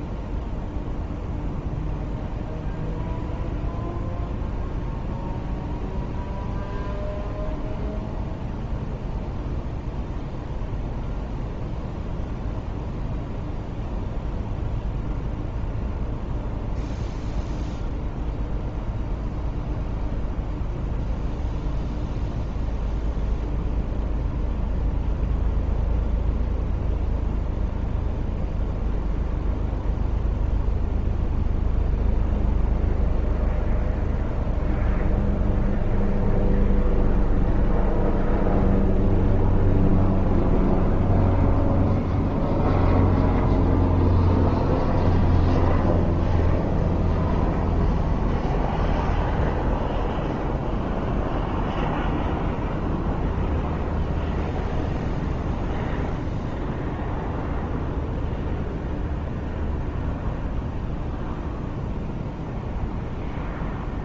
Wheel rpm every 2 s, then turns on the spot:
0, 0, 0, 0, 0, 0, 0, 0, 0, 0, 0, 0, 0, 0, 0, 0, 0, 0, 0, 0, 0, 0, 0, 0, 0, 0, 0, 0, 0, 0, 0, 0.
none